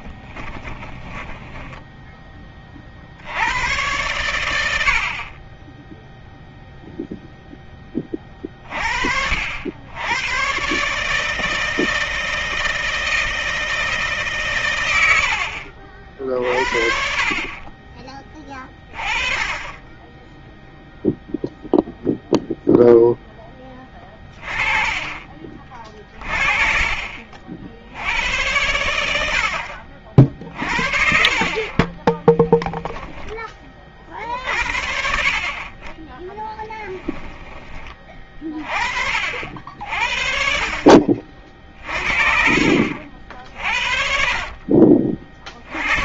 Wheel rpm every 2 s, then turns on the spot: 10, 60, 50, 0, 60, 150, 160, 90, 50, 20, 0, 10, 30, 40, 80, 50, 10, 50, 10, 30, 40, 50, 50.
0-2 36-38 44-46